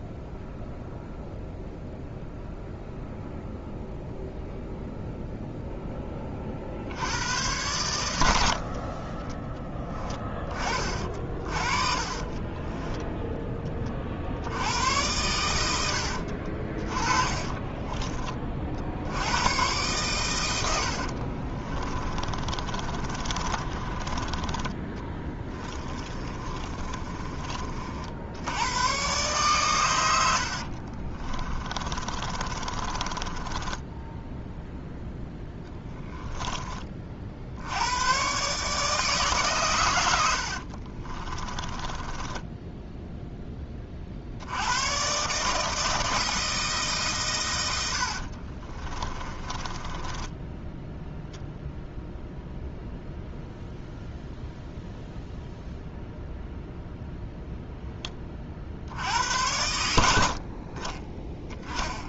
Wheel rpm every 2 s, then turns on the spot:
0, 0, 0, 60, 50, 30, 20, 90, 40, 60, 70, 30, 30, 20, 120, 50, 30, 0, 30, 150, 50, 10, 90, 160, 40, 10, 0, 0, 0, 60, 40.
8-10 12-14 16-18 22-28 30-34 40-44 48-52